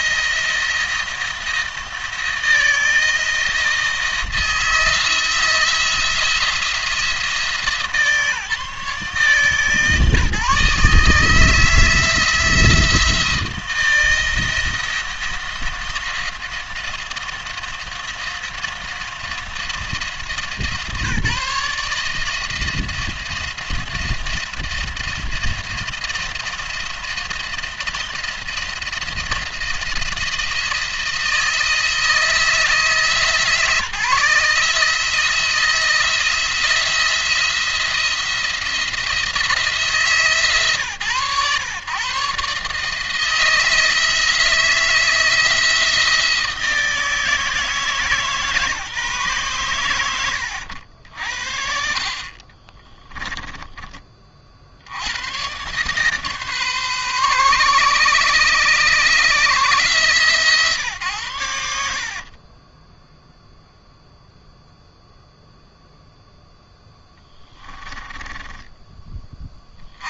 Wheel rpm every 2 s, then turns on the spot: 170, 160, 160, 160, 150, 150, 160, 170, 170, 170, 140, 160, 160, 170, 170, 160, 160, 160, 170, 170, 140, 150, 160, 160, 150, 80, 40, 60, 140, 140, 130, 30, 0, 0, 20.
52-54 62-64